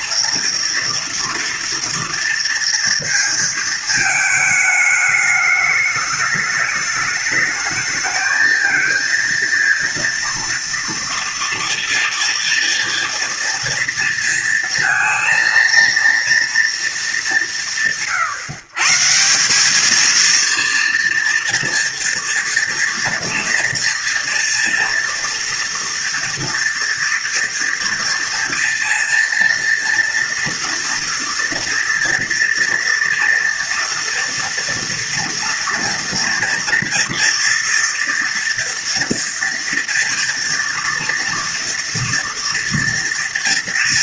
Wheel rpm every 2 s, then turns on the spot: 230, 230, 210, 210, 220, 230, 230, 230, 230, 130, 230, 230, 230, 230, 230, 230, 240, 240, 240, 230, 230, 230.
none